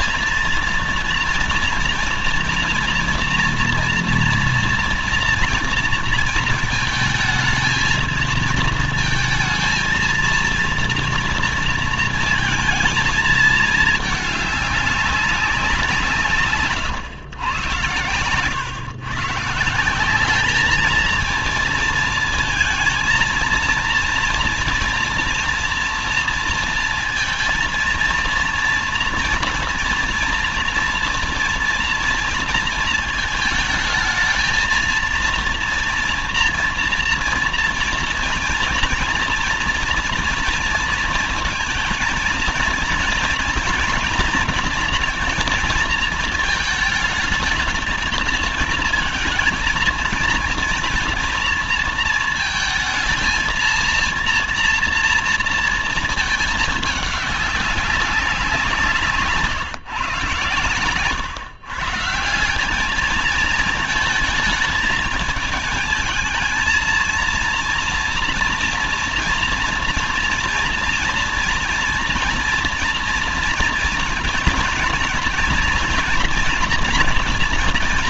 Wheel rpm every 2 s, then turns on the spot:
230, 230, 240, 220, 220, 230, 230, 200, 150, 120, 220, 230, 230, 230, 230, 230, 230, 230, 230, 230, 230, 230, 240, 220, 220, 240, 220, 230, 210, 170, 120, 200, 220, 220, 230, 230, 240, 230, 230.
60-62